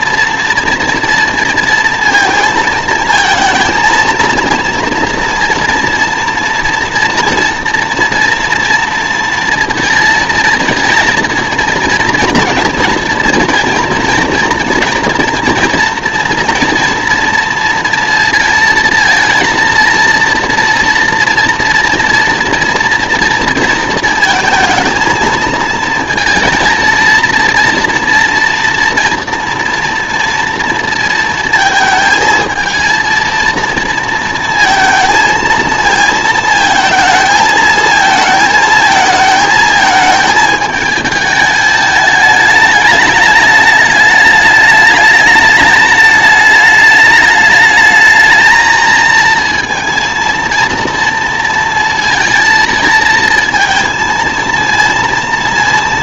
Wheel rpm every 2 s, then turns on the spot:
230, 230, 230, 230, 240, 230, 230, 230, 230, 230, 230, 240, 220, 230, 230, 230, 230, 230, 220, 220, 220, 210, 210, 210, 220, 230, 230, 230.
none